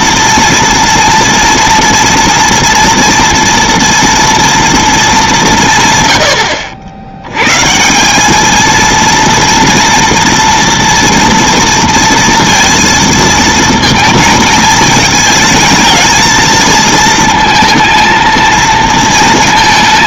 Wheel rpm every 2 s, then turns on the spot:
230, 240, 230, 70, 220, 230, 230, 220, 220, 230.
none